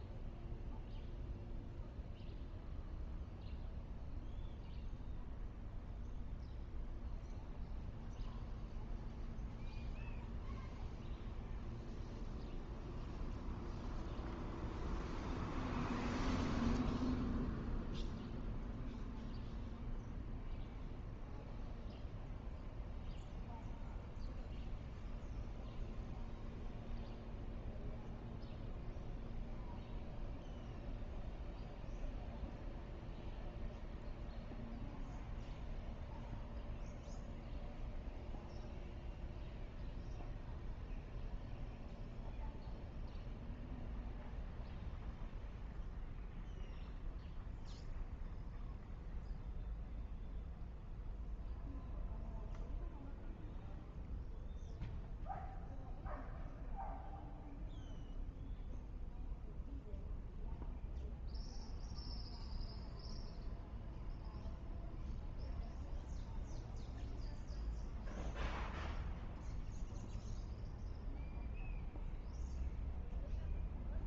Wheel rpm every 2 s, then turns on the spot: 0, 0, 0, 0, 0, 0, 0, 0, 0, 0, 0, 0, 0, 0, 0, 0, 0, 0, 0, 0, 0, 0, 0, 0, 0, 0, 0, 0, 0, 0, 0, 0, 0, 0, 0, 0, 0.
none